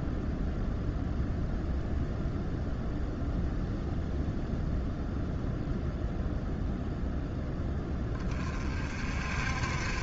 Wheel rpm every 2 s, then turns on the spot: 0, 0, 0, 0, 40.
none